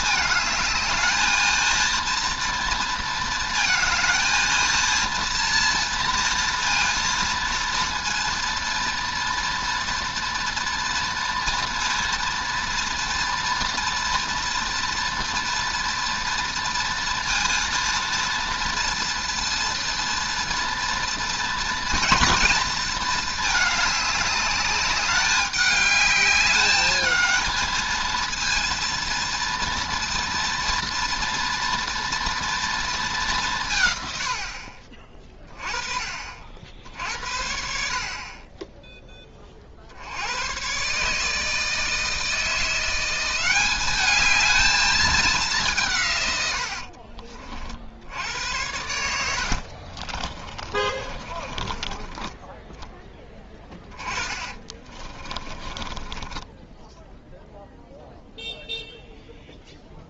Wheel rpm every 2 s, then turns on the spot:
220, 230, 230, 230, 230, 240, 230, 230, 230, 230, 230, 230, 200, 210, 230, 240, 230, 60, 60, 20, 120, 170, 210, 80, 90, 30, 20, 20, 10, 0.
34-36 46-48 50-52 54-58